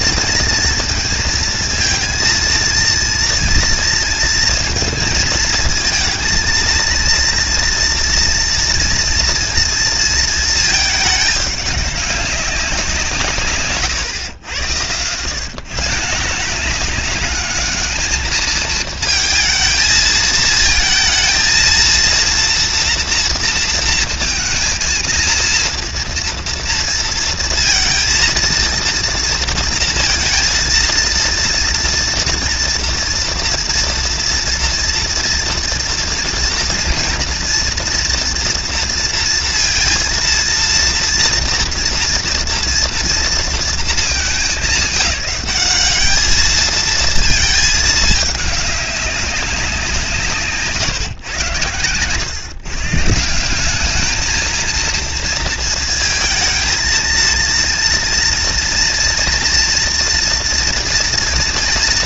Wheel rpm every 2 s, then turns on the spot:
230, 230, 230, 230, 230, 220, 170, 110, 210, 220, 230, 240, 230, 230, 230, 230, 230, 230, 240, 230, 230, 230, 190, 220, 200, 140, 150, 230, 220, 230, 230.
none